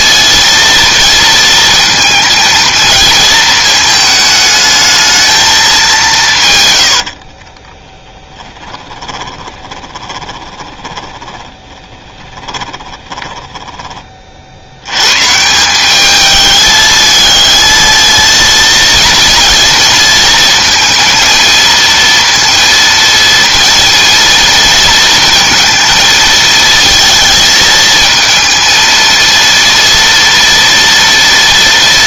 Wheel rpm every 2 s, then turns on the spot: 230, 220, 220, 110, 20, 20, 20, 80, 220, 230, 230, 230, 230, 230, 220, 230.
8-14